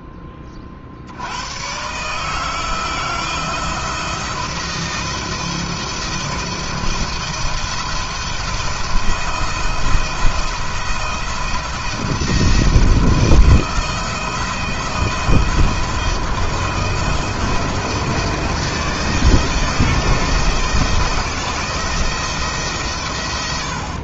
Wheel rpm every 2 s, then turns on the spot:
50, 170, 170, 160, 170, 170, 170, 170, 170, 160, 160, 140.
none